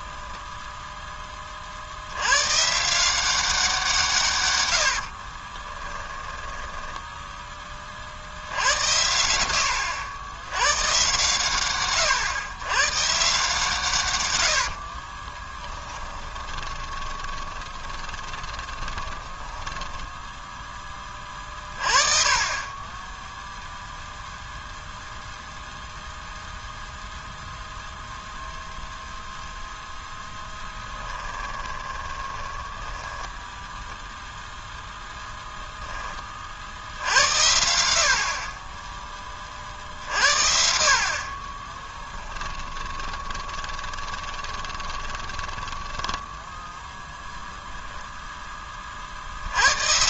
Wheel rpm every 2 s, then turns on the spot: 0, 140, 90, 10, 80, 120, 130, 60, 20, 20, 10, 20, 0, 0, 0, 10, 10, 0, 60, 20, 50, 20, 20, 0, 30.
4-8 14-20 30-34 42-46